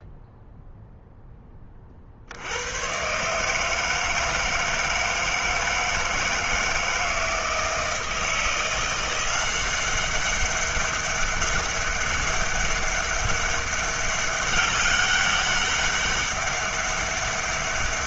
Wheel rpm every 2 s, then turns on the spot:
0, 100, 160, 160, 170, 200, 200, 200, 200.
none